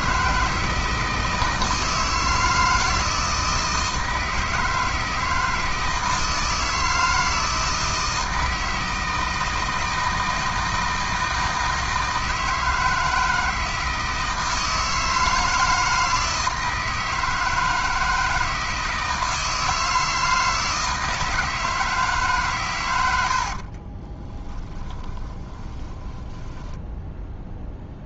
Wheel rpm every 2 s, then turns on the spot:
160, 160, 160, 160, 160, 160, 160, 160, 160, 160, 160, 110, 10, 10.
24-26